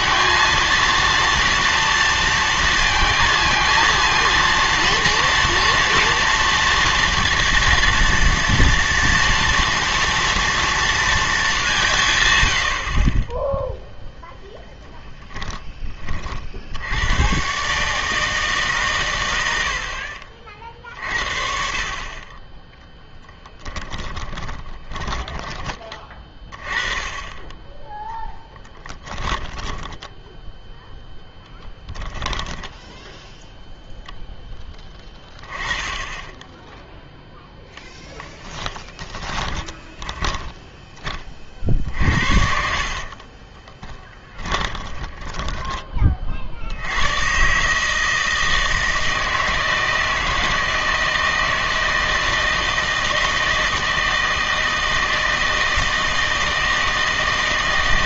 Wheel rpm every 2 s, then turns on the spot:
230, 230, 230, 230, 230, 230, 90, 10, 70, 150, 50, 20, 20, 30, 10, 0, 20, 10, 10, 10, 10, 60, 10, 60, 160, 160, 160, 160, 160.
24-26 28-30 32-34 38-46